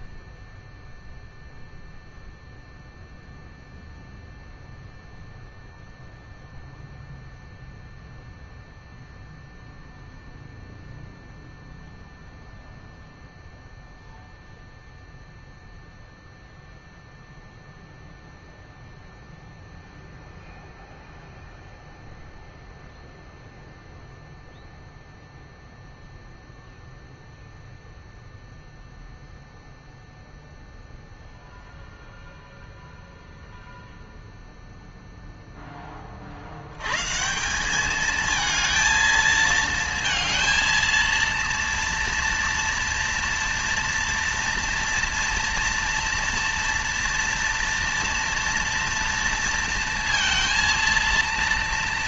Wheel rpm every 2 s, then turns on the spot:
0, 0, 0, 0, 0, 0, 0, 0, 0, 0, 0, 0, 0, 0, 0, 0, 0, 0, 150, 220, 230, 230, 230, 230, 230, 230.
none